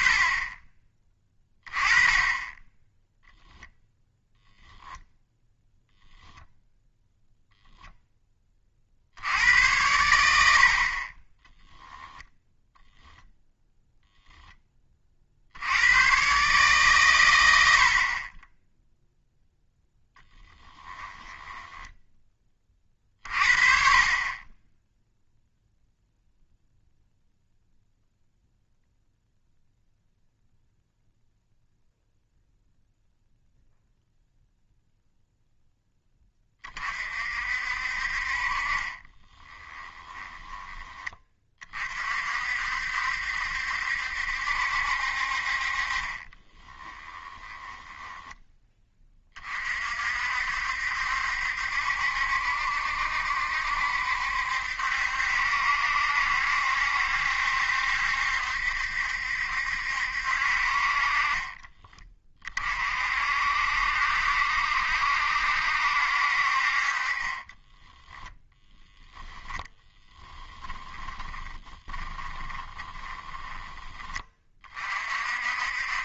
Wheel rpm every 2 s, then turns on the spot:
20, 10, 0, 0, 60, 50, 0, 30, 140, 0, 10, 40, 10, 0, 0, 0, 0, 0, 40, 30, 20, 70, 60, 10, 20, 70, 70, 70, 70, 70, 40, 50, 70, 40, 0, 30, 20, 40.
20-22 38-40 46-48 70-74